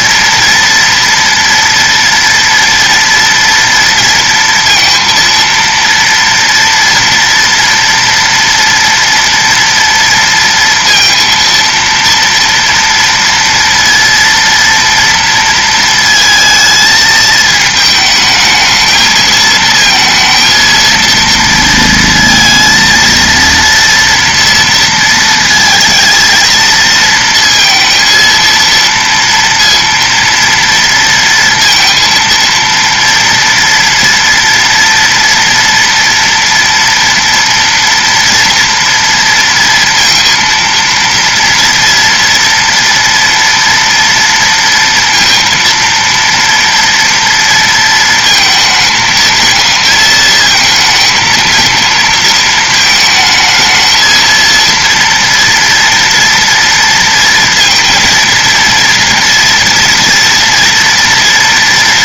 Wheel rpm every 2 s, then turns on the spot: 230, 230, 230, 230, 230, 230, 230, 230, 220, 220, 230, 230, 230, 230, 230, 230, 230, 230, 240, 230, 230, 230, 230, 230, 230, 220, 220, 230, 230, 230, 230.
none